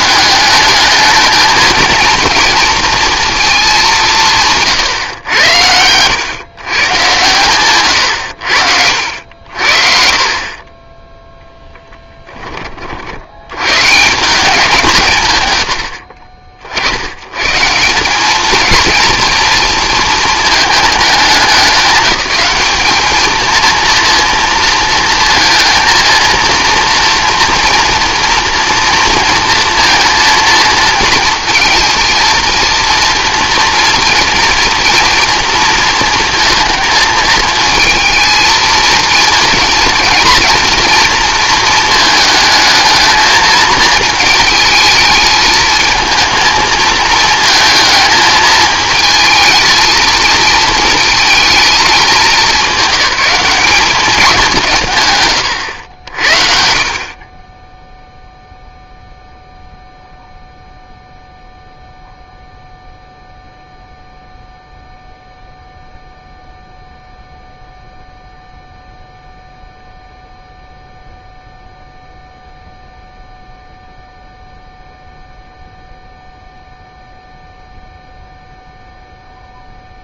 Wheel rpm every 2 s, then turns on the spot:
210, 230, 130, 130, 70, 20, 40, 160, 70, 220, 210, 200, 230, 230, 230, 230, 230, 230, 220, 230, 230, 220, 220, 230, 220, 220, 200, 150, 50, 0, 0, 0, 0, 0, 0, 0, 0, 0, 0, 0.
none